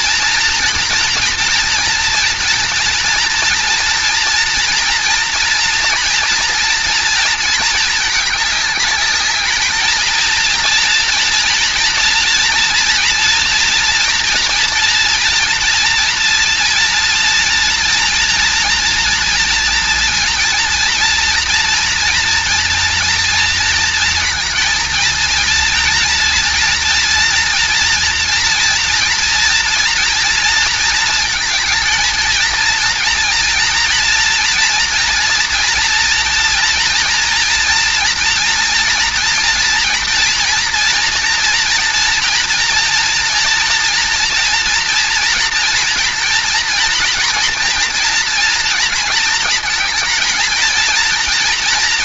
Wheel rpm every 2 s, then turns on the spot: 230, 230, 230, 230, 210, 230, 230, 230, 230, 230, 230, 230, 230, 230, 230, 220, 230, 240, 230, 230, 230, 230, 230, 230, 230, 230.
none